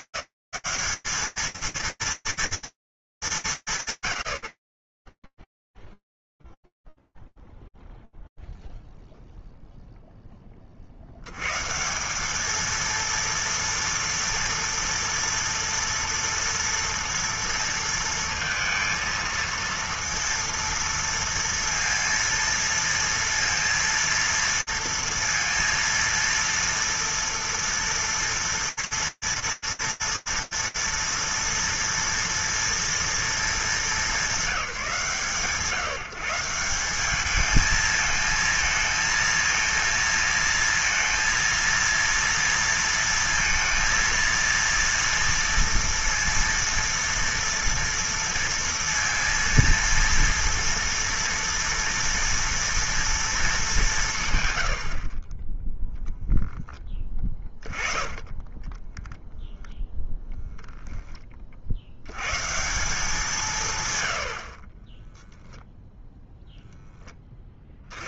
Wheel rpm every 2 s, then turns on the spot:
190, 230, 130, 0, 0, 10, 190, 230, 230, 230, 230, 230, 230, 230, 230, 230, 230, 200, 180, 220, 230, 230, 230, 230, 230, 230, 230, 50, 10, 10, 20, 170, 10, 10.
56-60